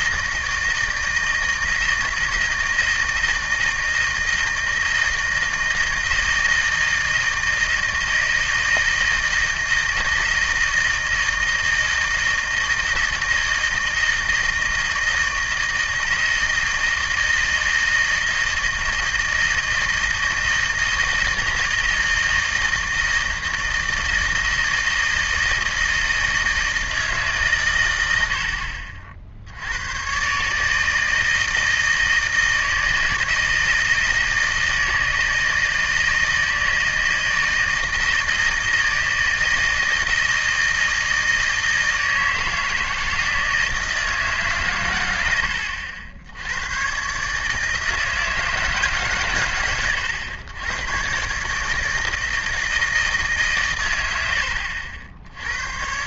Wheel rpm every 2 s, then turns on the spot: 160, 160, 160, 160, 160, 160, 160, 160, 160, 160, 160, 160, 160, 160, 70, 150, 160, 160, 160, 160, 160, 160, 140, 100, 160, 100, 160, 70.
none